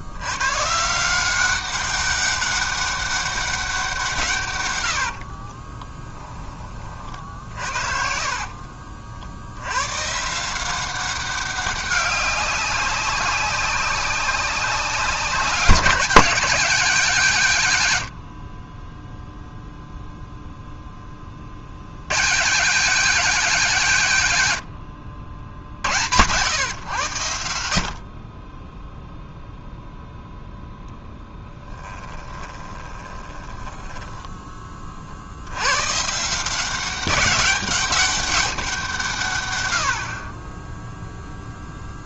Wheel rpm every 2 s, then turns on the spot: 170, 200, 90, 30, 40, 170, 190, 190, 200, 20, 0, 170, 100, 120, 10, 10, 20, 30, 180, 190, 10.
4-6 32-34